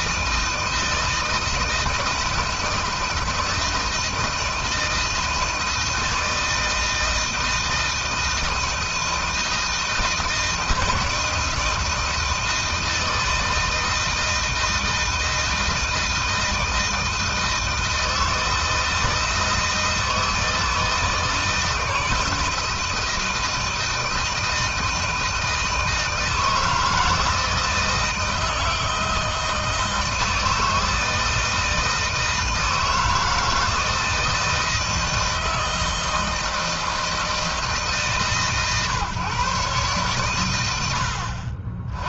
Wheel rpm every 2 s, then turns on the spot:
160, 160, 160, 160, 160, 160, 160, 160, 160, 160, 160, 160, 160, 160, 160, 160, 160, 160, 160, 140, 100.
none